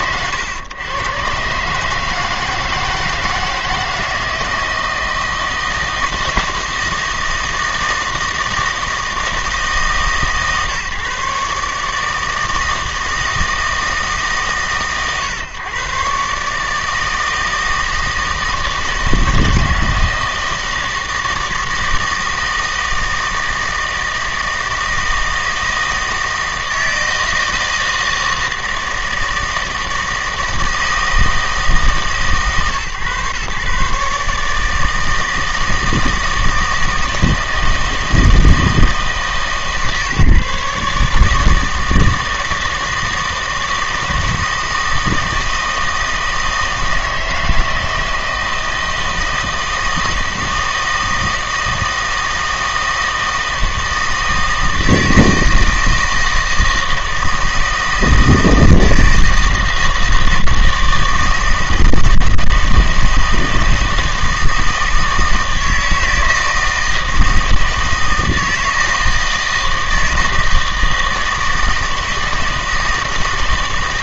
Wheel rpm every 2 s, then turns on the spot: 110, 160, 160, 170, 160, 140, 160, 130, 150, 160, 160, 160, 160, 160, 160, 160, 130, 160, 160, 160, 140, 160, 160, 160, 160, 160, 160, 160, 160, 160, 160, 160, 160, 160, 160, 160, 160.
none